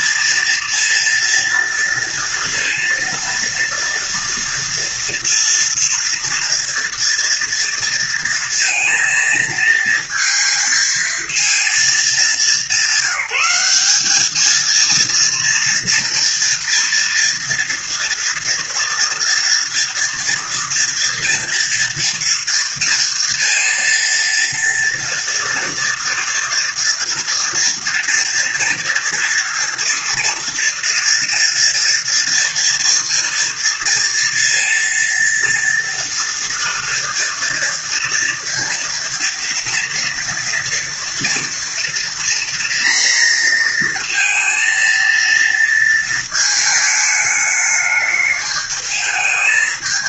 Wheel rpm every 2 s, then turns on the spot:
230, 230, 230, 230, 230, 230, 200, 220, 230, 230, 230, 230, 230, 230, 230, 230, 230, 230, 230, 230, 230, 240, 230, 220, 210.
none